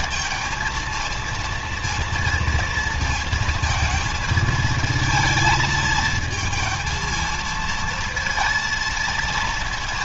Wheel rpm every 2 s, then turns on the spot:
230, 230, 220, 230, 230.
none